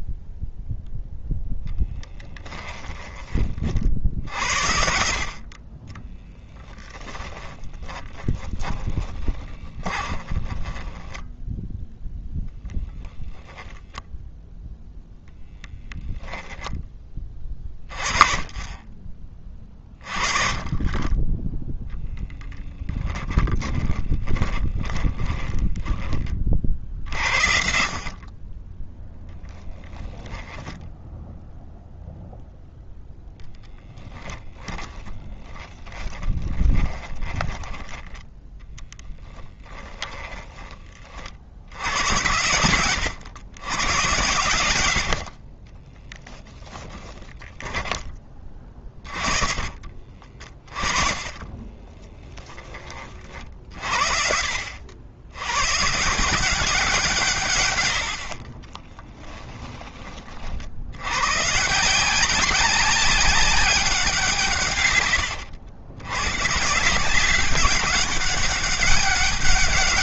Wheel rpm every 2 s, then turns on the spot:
0, 20, 50, 10, 10, 10, 10, 0, 20, 30, 20, 10, 20, 30, 10, 10, 0, 10, 20, 10, 30, 110, 100, 10, 40, 30, 30, 80, 160, 20, 90, 200, 120, 160, 200.
6-14 22-26 34-40 46-52 58-60